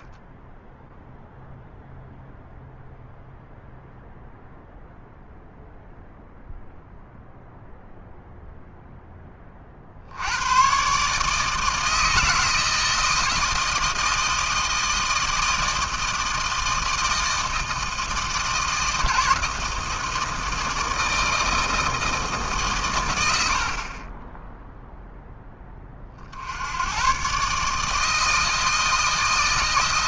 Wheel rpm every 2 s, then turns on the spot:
10, 0, 0, 0, 0, 110, 160, 160, 160, 160, 160, 140, 0, 70, 160.
none